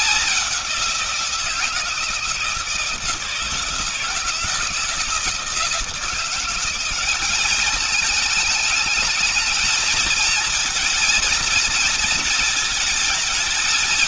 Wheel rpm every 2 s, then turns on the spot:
190, 160, 170, 180, 210, 220, 230.
none